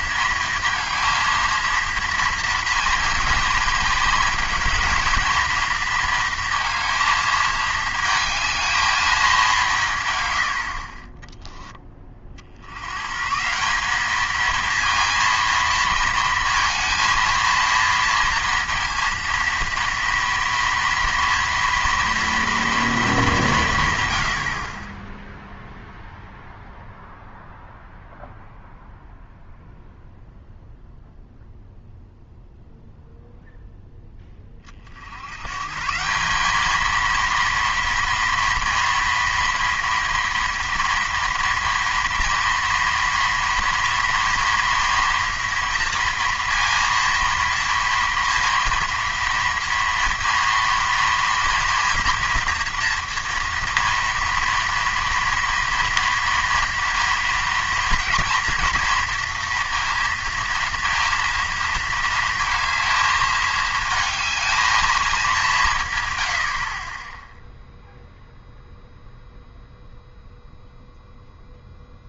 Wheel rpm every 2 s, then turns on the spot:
230, 230, 230, 230, 220, 70, 80, 230, 230, 230, 230, 230, 50, 0, 0, 0, 0, 30, 210, 230, 230, 230, 240, 240, 230, 230, 230, 230, 230, 230, 230, 220, 230, 50, 0, 0.
none